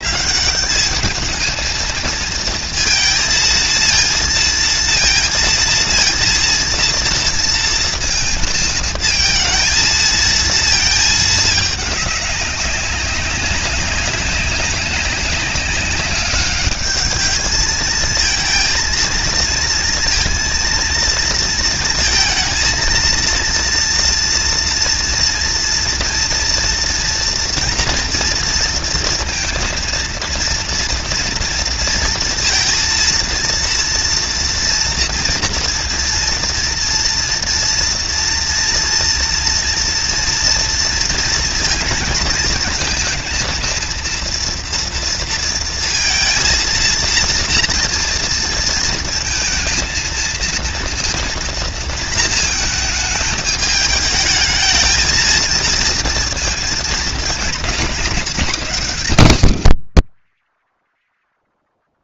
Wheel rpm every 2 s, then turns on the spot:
210, 230, 230, 230, 230, 220, 200, 200, 200, 220, 230, 230, 230, 230, 230, 230, 230, 230, 230, 240, 240, 230, 230, 220, 230, 230, 220, 220, 230, 220, 50.
none